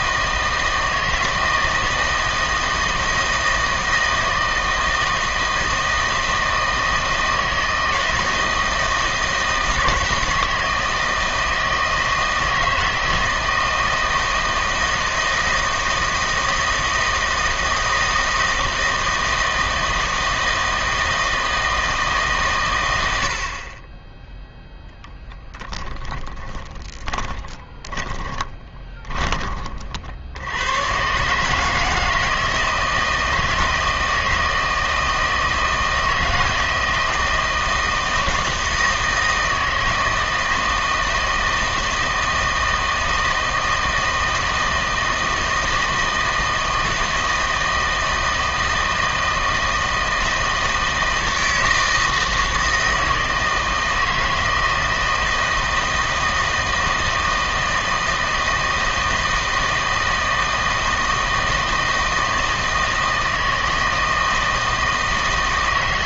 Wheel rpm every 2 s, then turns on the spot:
160, 160, 160, 160, 160, 160, 160, 160, 160, 160, 160, 110, 0, 20, 20, 110, 160, 160, 160, 160, 160, 160, 160, 160, 160, 160, 160, 160, 160, 160, 160, 160, 160.
26-30